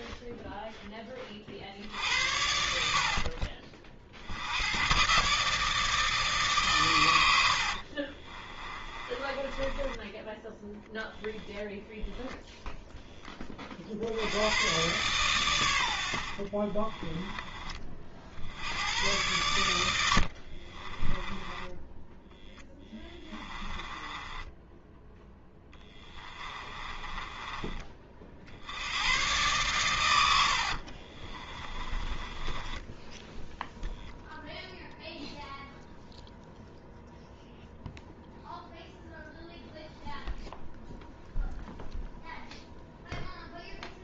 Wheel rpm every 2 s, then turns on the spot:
10, 60, 110, 130, 20, 10, 0, 120, 40, 80, 30, 10, 10, 20, 80, 60, 10, 0, 0, 0, 0, 0.
8-10 16-18 20-28 30-34